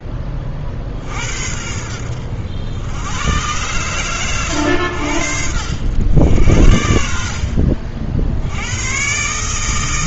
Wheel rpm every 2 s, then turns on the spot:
60, 90, 90, 60, 120.
none